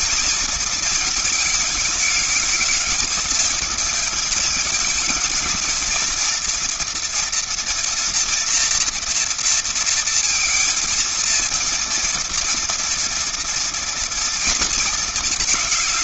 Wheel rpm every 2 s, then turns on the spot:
230, 220, 220, 230, 240, 230, 230, 230.
none